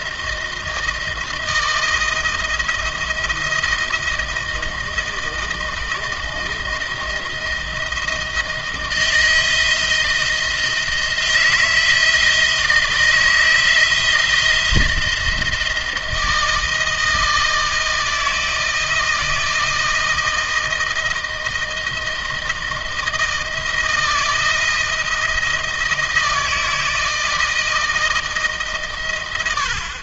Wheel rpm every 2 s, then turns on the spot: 170, 160, 160, 160, 160, 160, 160, 160, 160, 160, 170, 160, 160, 160, 140.
none